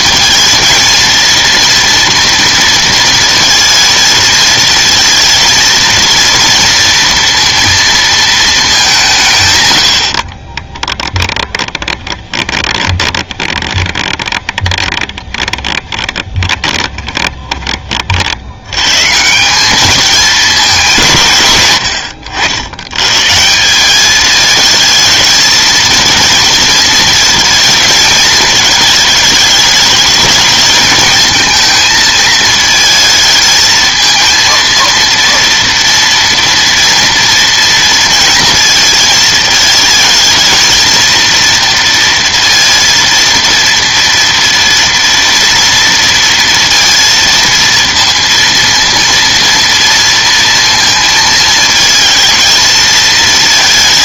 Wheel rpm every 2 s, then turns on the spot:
230, 230, 230, 230, 200, 20, 20, 20, 20, 100, 210, 90, 220, 230, 220, 220, 220, 230, 230, 230, 220, 230, 230, 230, 230, 230, 230.
10-18